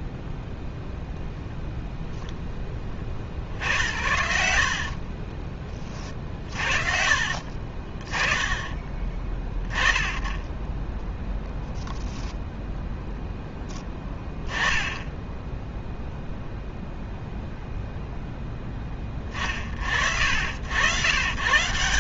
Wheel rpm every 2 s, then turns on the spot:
0, 10, 70, 50, 20, 20, 0, 30, 0, 0, 60.
6-8